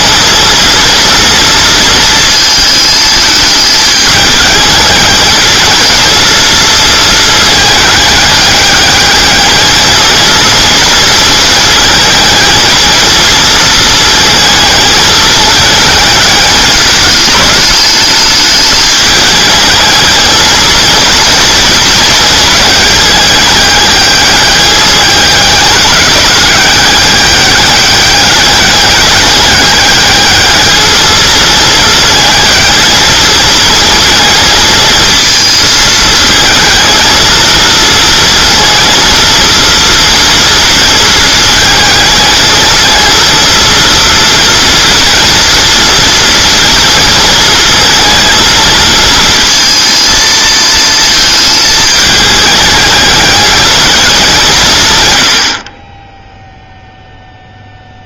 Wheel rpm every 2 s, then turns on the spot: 230, 220, 210, 230, 210, 230, 230, 220, 210, 210, 230, 210, 210, 200, 200, 220, 220, 220, 220, 230, 230, 220, 230, 220, 230, 220, 210, 160, 0.
none